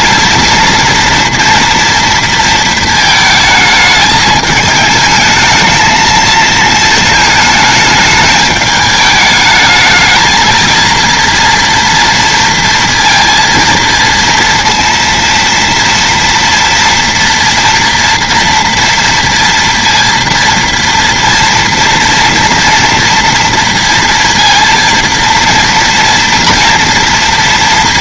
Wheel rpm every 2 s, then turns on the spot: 230, 230, 210, 220, 210, 220, 230, 230, 230, 230, 230, 230, 230, 230.
none